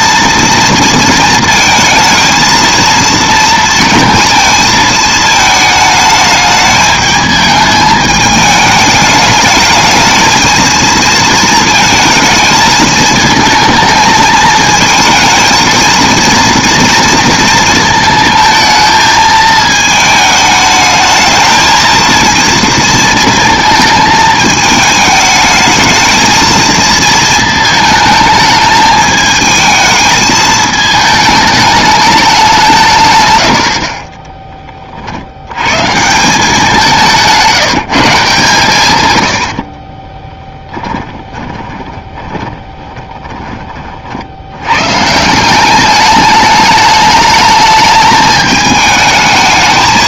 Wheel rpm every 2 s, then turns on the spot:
230, 230, 220, 220, 210, 230, 220, 230, 230, 220, 220, 230, 210, 230, 220, 220, 130, 50, 180, 120, 30, 20, 120, 210, 210.
40-44